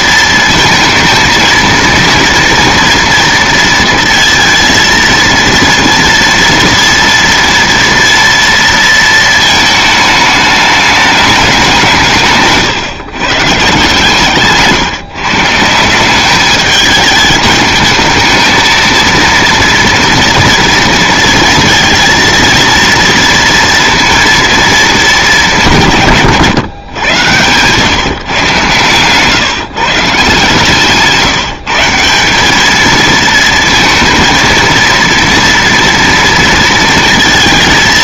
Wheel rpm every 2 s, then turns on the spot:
230, 230, 230, 230, 230, 210, 140, 150, 210, 220, 230, 230, 220, 130, 130, 150, 210, 230, 230.
none